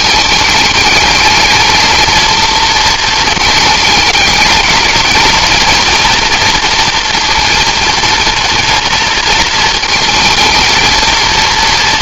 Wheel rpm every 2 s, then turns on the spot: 220, 220, 230, 230, 220, 230.
none